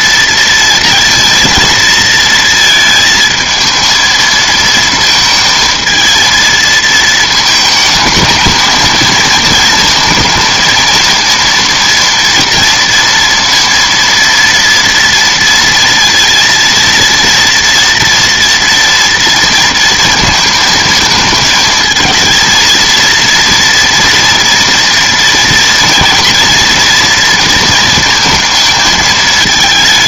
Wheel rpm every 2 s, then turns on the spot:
230, 220, 230, 220, 220, 220, 230, 230, 230, 230, 220, 230, 230, 230, 220.
none